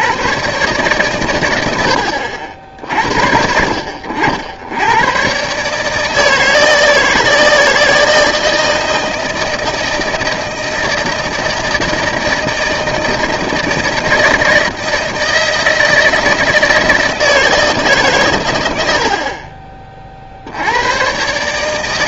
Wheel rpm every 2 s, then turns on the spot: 130, 60, 90, 160, 160, 160, 160, 160, 160, 90, 80.
none